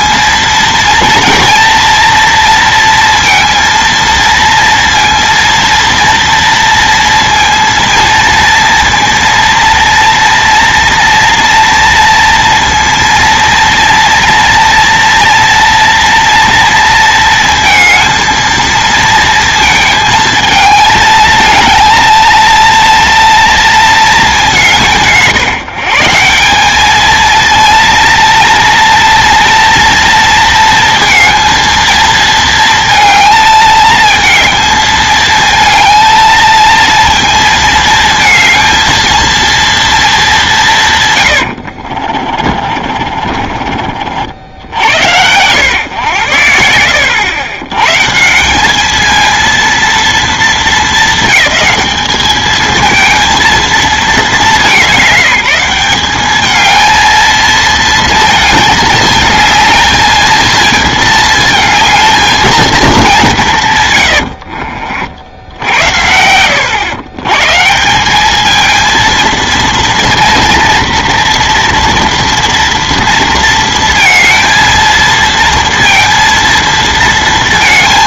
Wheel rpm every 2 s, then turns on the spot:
230, 230, 230, 230, 230, 230, 230, 230, 230, 230, 220, 230, 190, 200, 230, 230, 230, 220, 230, 220, 160, 40, 60, 80, 200, 220, 220, 170, 220, 220, 220, 220, 60, 100, 220, 230, 230, 230, 230.
42-44 64-66